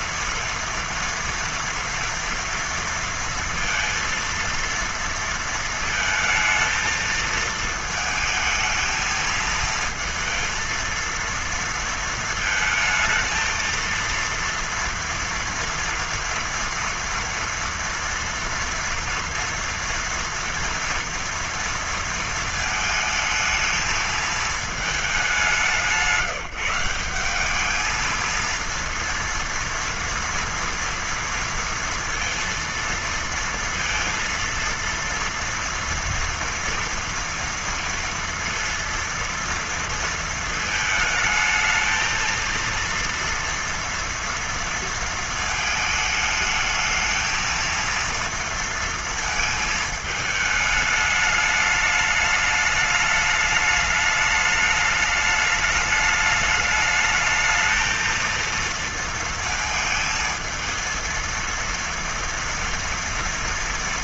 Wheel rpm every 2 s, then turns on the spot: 230, 230, 230, 230, 220, 230, 220, 230, 230, 240, 230, 220, 220, 160, 230, 230, 230, 230, 230, 230, 220, 230, 230, 220, 230, 210, 210, 210, 220, 230, 220, 230.
none